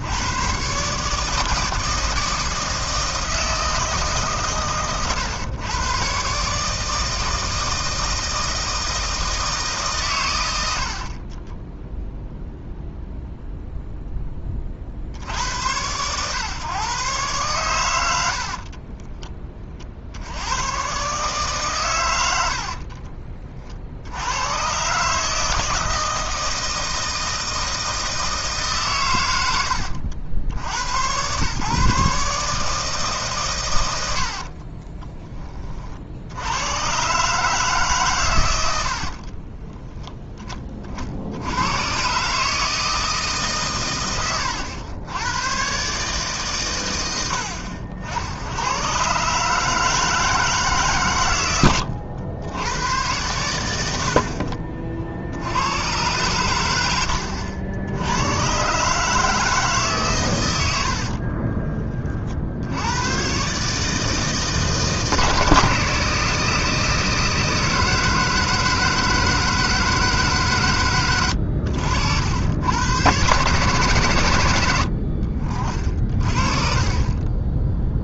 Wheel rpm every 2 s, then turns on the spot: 140, 160, 130, 160, 160, 70, 0, 50, 130, 30, 110, 50, 130, 160, 130, 80, 150, 30, 120, 70, 50, 160, 100, 100, 120, 140, 100, 50, 90, 140, 80, 90, 160, 160, 160, 120, 120, 80, 40.
18-20 22-24 34-36 60-62